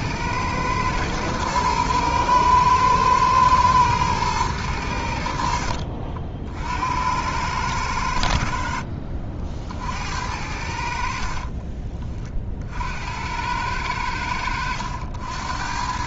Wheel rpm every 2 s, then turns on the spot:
110, 110, 100, 70, 60, 70, 60, 80.
none